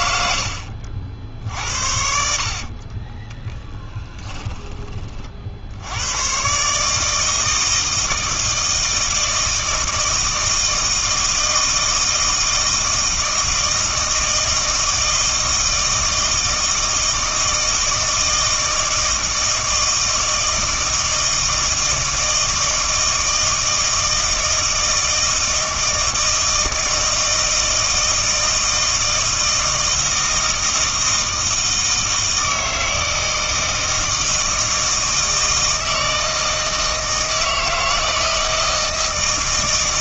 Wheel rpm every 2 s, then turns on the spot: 70, 50, 10, 140, 160, 160, 160, 160, 160, 160, 160, 160, 160, 160, 160, 160, 160, 160, 160, 160.
2-6